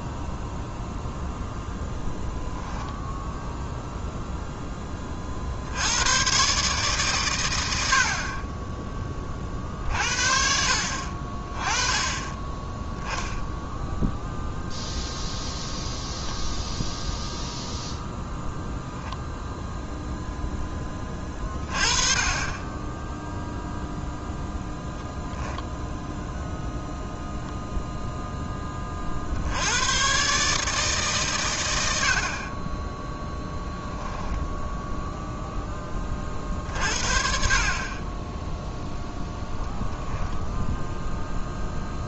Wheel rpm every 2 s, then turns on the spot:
0, 0, 30, 140, 10, 40, 0, 0, 0, 0, 10, 10, 0, 0, 40, 140, 10, 0, 50, 0, 0.
none